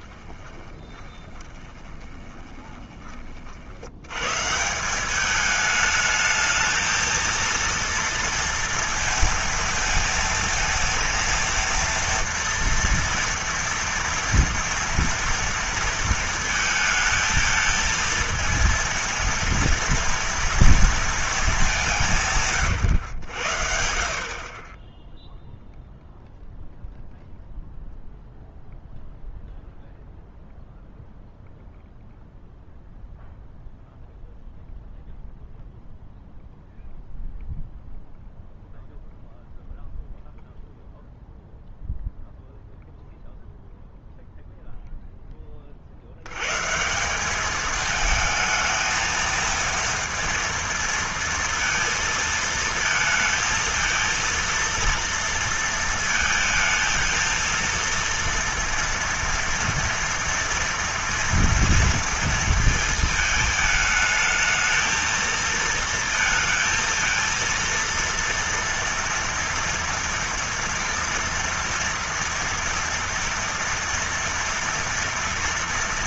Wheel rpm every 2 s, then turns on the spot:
20, 20, 140, 220, 230, 230, 230, 230, 230, 230, 230, 150, 40, 0, 0, 0, 0, 0, 0, 0, 0, 0, 0, 120, 220, 230, 220, 230, 220, 230, 230, 230, 220, 230, 230, 230, 230, 230.
0-4